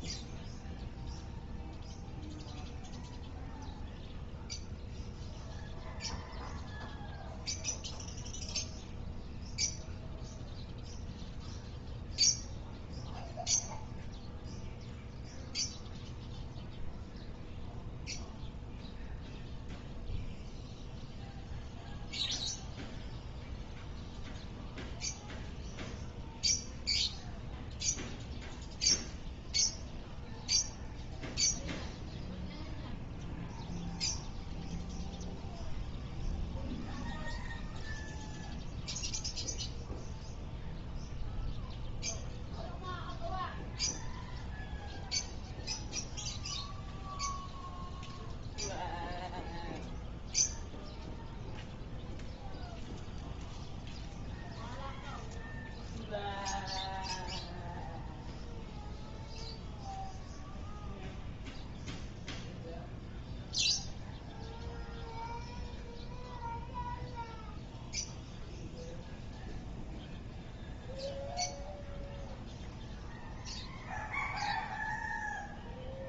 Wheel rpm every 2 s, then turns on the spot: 0, 0, 0, 0, 0, 0, 0, 0, 0, 0, 0, 0, 0, 0, 0, 0, 0, 0, 0, 0, 0, 0, 0, 0, 0, 0, 0, 0, 0, 0, 0, 0, 0, 0, 0, 0, 0, 0.
none